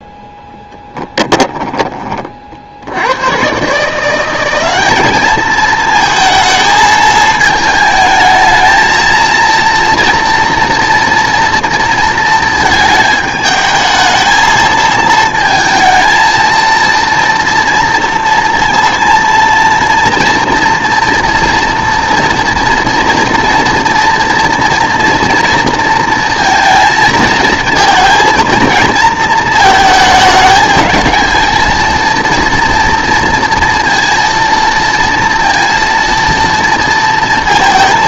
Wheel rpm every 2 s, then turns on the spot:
10, 60, 190, 220, 220, 230, 220, 220, 230, 230, 240, 240, 240, 220, 230, 220, 230, 230, 230.
0-2